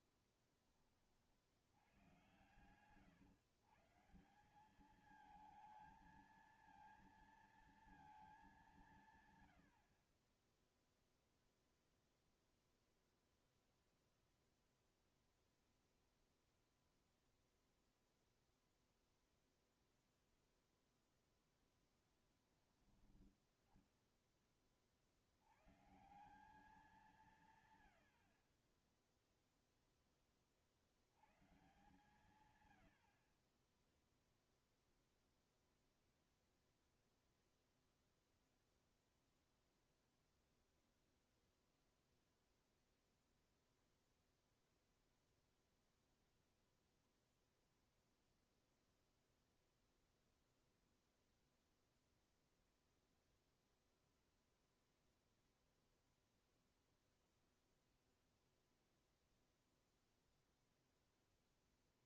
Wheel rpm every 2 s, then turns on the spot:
40, 120, 180, 230, 200, 20, 0, 0, 0, 0, 0, 20, 30, 170, 40, 40, 120, 0, 0, 0, 0, 0, 0, 0, 0, 0, 0, 0, 0, 0, 0.
0-2